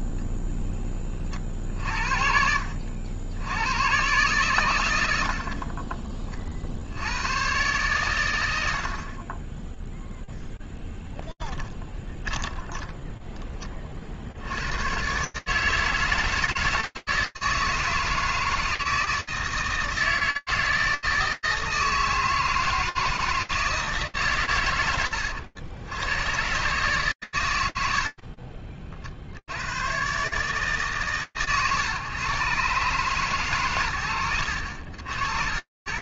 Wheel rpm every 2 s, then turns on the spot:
20, 60, 130, 40, 100, 0, 10, 80, 160, 160, 160, 160, 160, 110, 90, 100, 130, 110.
12-14